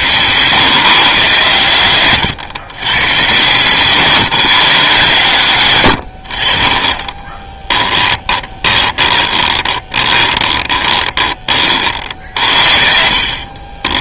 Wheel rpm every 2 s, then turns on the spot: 130, 130, 140, 30, 20, 20, 60.
6-12